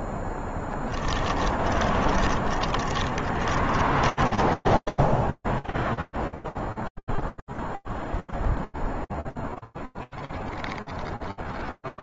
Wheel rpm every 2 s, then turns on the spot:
10, 30, 10, 0, 0, 0.
0-6